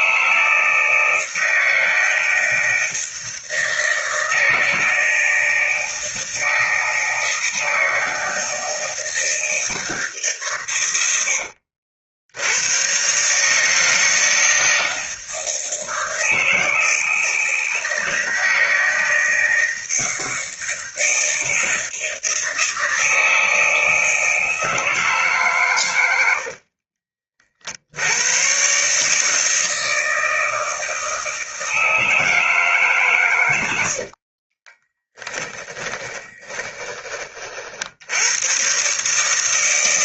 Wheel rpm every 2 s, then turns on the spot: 160, 160, 160, 160, 160, 110, 120, 160, 160, 160, 170, 160, 160, 50, 140, 160, 140, 20, 20, 130.
10-12 26-28 34-36